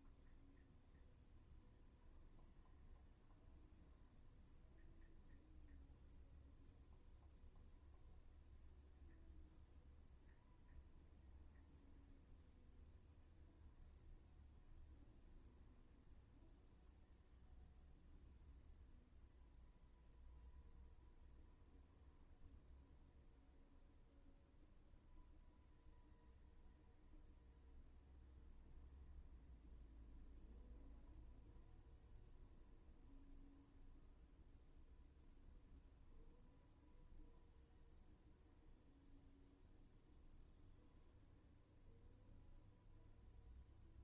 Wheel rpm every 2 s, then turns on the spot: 0, 0, 0, 0, 0, 0, 0, 0, 0, 0, 0, 0, 0, 0, 0, 0, 0, 0, 0, 0, 0, 0.
none